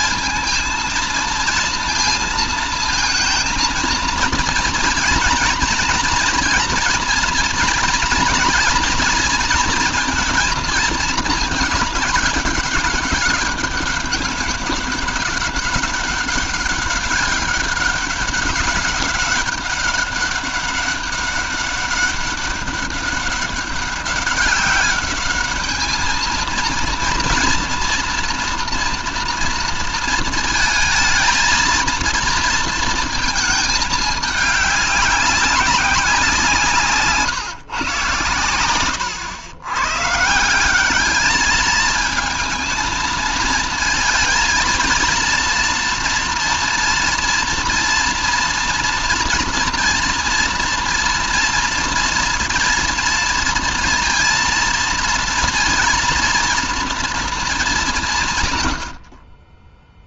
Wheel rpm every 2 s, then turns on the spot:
230, 230, 230, 230, 230, 220, 200, 200, 200, 200, 200, 200, 200, 230, 230, 220, 230, 200, 170, 110, 190, 220, 230, 230, 230, 230, 230, 230, 230, 110.
none